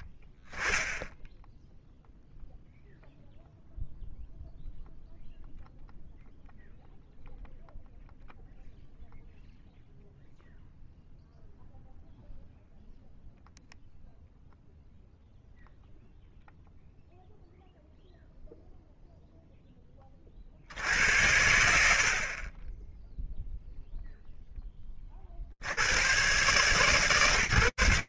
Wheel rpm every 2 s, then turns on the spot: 0, 0, 0, 0, 0, 0, 0, 0, 0, 10, 60, 0, 90, 110.
none